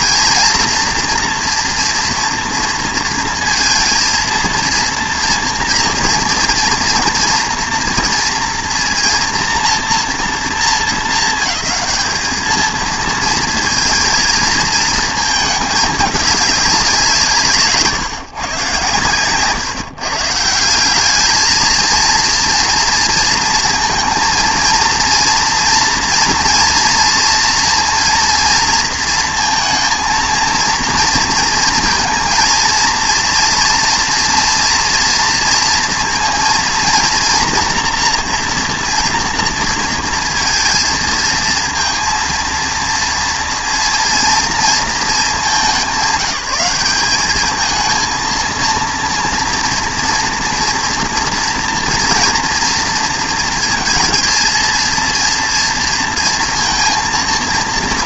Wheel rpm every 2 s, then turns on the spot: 240, 230, 230, 230, 240, 210, 220, 230, 200, 130, 190, 230, 230, 230, 230, 230, 230, 240, 230, 240, 230, 230, 230, 200, 230, 230, 230, 230, 230.
none